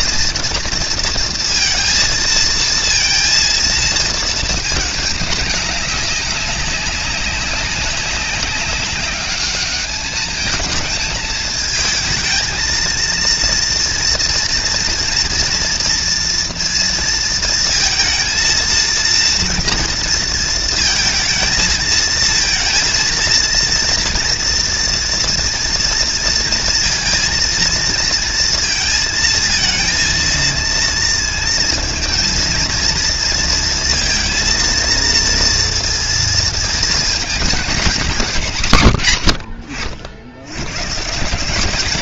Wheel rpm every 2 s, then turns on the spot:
230, 230, 220, 200, 200, 220, 230, 230, 230, 230, 230, 230, 240, 230, 230, 230, 230, 230, 230, 150, 110.
none